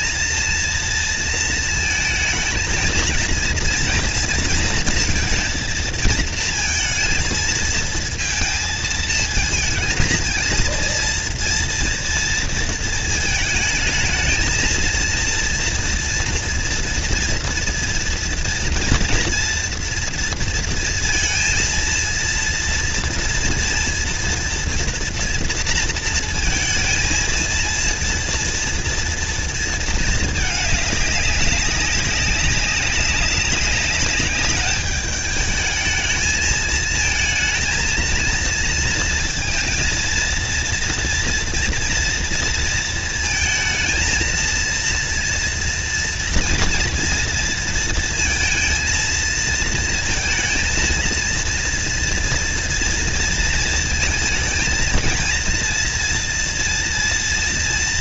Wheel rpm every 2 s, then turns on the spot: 230, 220, 230, 220, 230, 230, 230, 230, 230, 230, 230, 230, 230, 230, 230, 210, 190, 200, 220, 230, 230, 230, 230, 230, 230, 230, 240, 230, 230.
none